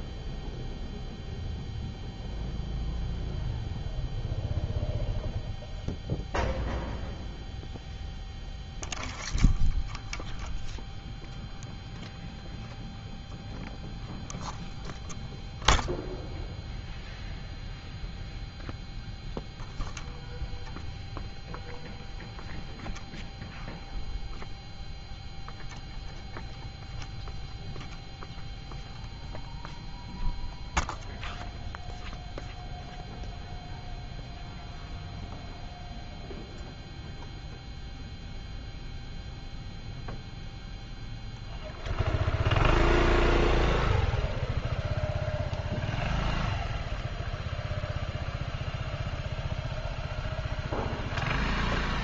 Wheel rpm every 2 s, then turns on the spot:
0, 0, 0, 0, 0, 0, 0, 0, 0, 0, 0, 0, 0, 0, 0, 0, 0, 0, 0, 0, 0, 0, 0, 0, 0, 0.
none